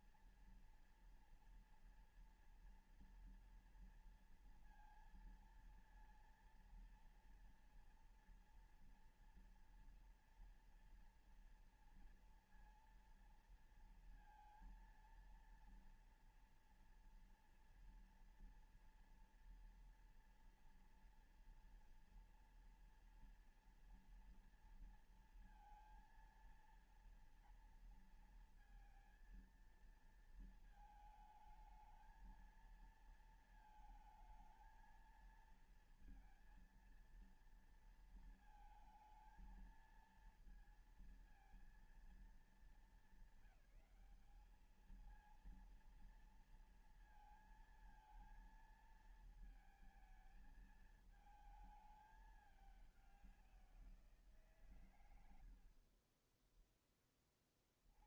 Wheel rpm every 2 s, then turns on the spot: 230, 230, 230, 230, 230, 230, 230, 230, 230, 230, 230, 230, 230, 230, 230, 220, 220, 220, 230, 220, 230, 220, 220, 230, 230, 220, 200, 140, 20.
none